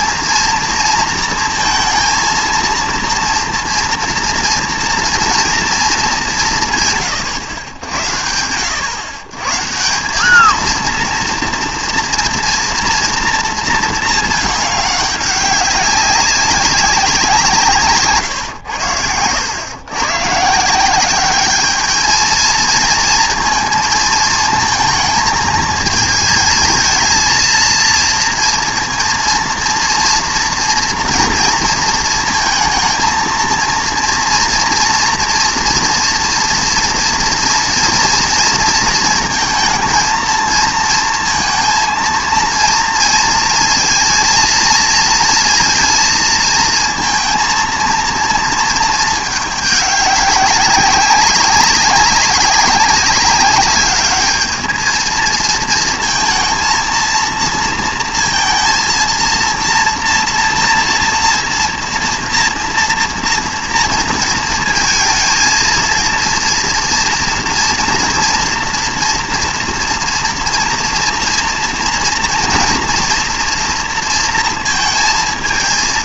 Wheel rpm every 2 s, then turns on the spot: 230, 230, 240, 150, 110, 230, 230, 200, 190, 100, 170, 230, 220, 220, 230, 230, 220, 230, 230, 230, 230, 230, 230, 220, 220, 190, 200, 220, 230, 230, 230, 230, 230, 230, 230, 230, 240, 230.
18-20